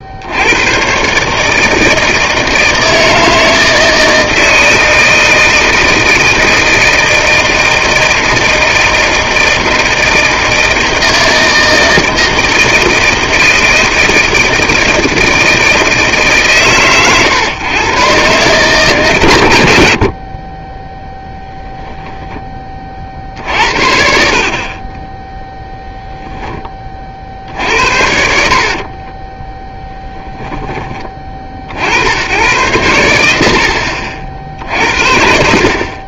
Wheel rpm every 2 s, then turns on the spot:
110, 160, 160, 160, 160, 160, 160, 160, 130, 130, 20, 30, 30, 10, 50, 10, 90, 60.
24-26 28-30